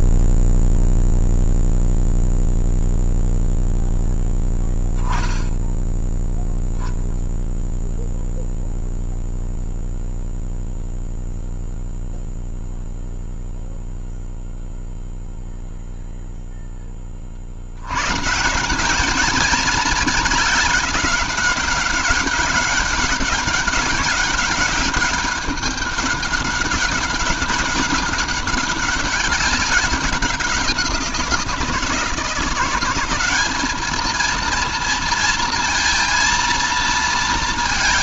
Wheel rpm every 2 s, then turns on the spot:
0, 0, 0, 0, 0, 0, 0, 0, 10, 170, 210, 200, 190, 200, 200, 180, 180, 230, 230.
none